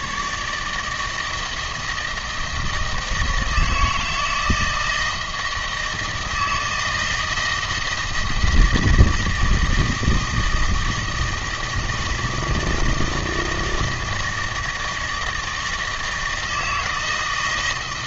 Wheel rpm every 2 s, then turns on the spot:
150, 160, 160, 160, 160, 160, 160, 160, 160.
none